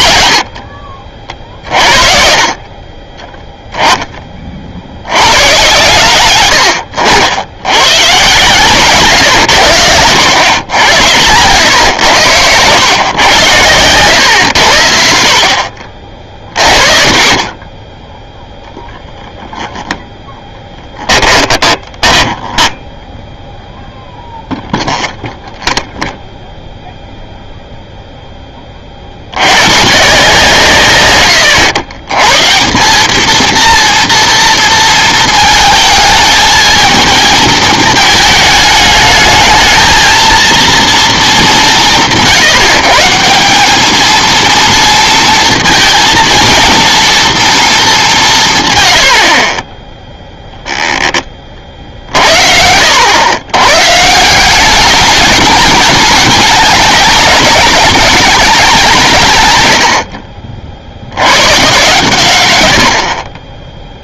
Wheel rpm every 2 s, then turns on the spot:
70, 30, 60, 100, 120, 90, 110, 80, 30, 0, 10, 10, 0, 0, 40, 130, 180, 230, 220, 210, 230, 150, 230, 230, 100, 10, 80, 200, 190, 170, 60, 90.
20-22